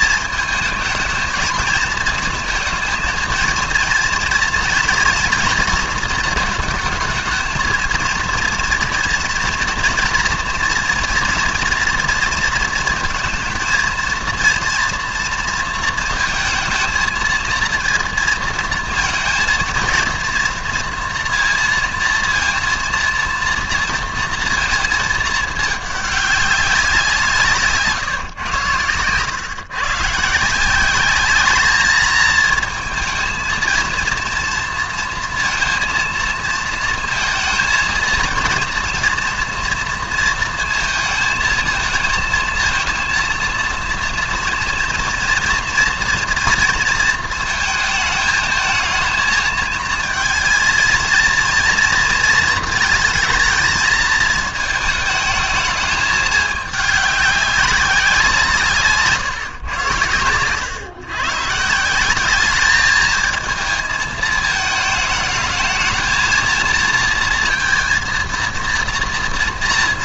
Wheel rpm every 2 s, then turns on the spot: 220, 230, 230, 220, 230, 230, 220, 240, 230, 230, 230, 230, 230, 190, 110, 180, 230, 230, 230, 230, 230, 220, 230, 230, 220, 230, 220, 220, 210, 150, 120, 210, 220, 230, 230.
none